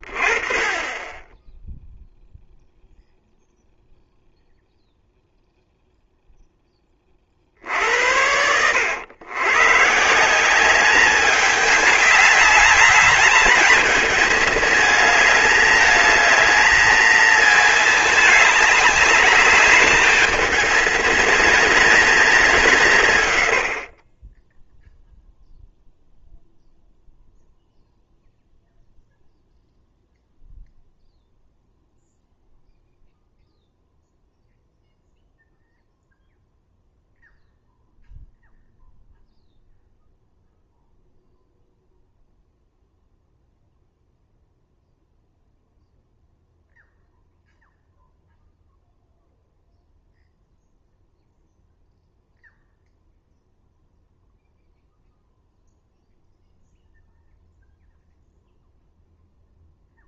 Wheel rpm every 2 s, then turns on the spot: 20, 0, 0, 10, 90, 190, 200, 210, 220, 210, 220, 180, 10, 0, 0, 0, 0, 0, 0, 0, 0, 0, 0, 0, 0, 0, 0, 0, 0, 0.
none